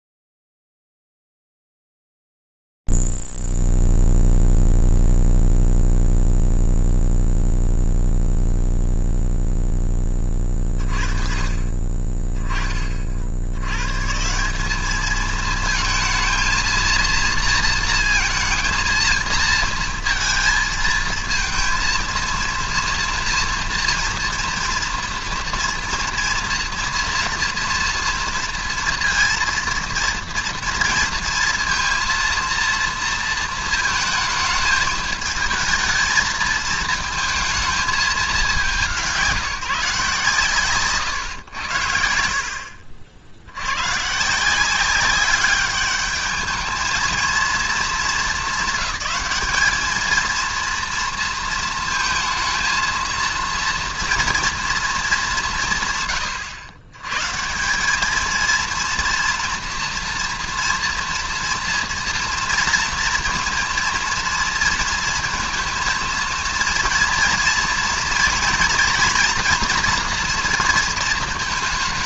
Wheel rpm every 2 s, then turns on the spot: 0, 0, 0, 0, 0, 20, 20, 150, 230, 220, 230, 230, 230, 230, 230, 230, 230, 220, 220, 190, 130, 70, 170, 210, 220, 230, 230, 230, 110, 230, 230, 230, 230, 230, 230, 230.
none